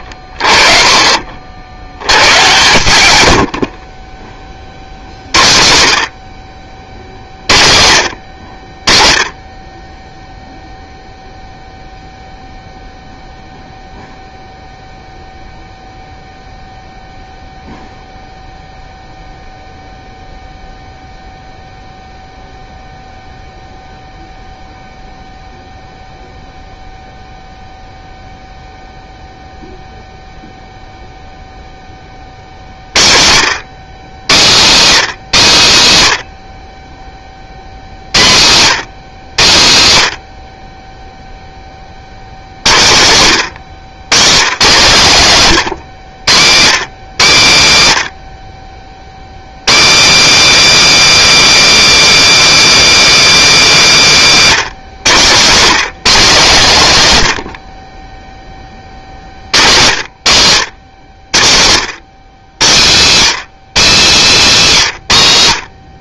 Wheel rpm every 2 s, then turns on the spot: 40, 120, 50, 60, 50, 0, 0, 0, 0, 0, 0, 0, 0, 0, 0, 0, 60, 180, 50, 140, 40, 90, 150, 140, 60, 330, 340, 200, 180, 40, 120, 140, 210.
none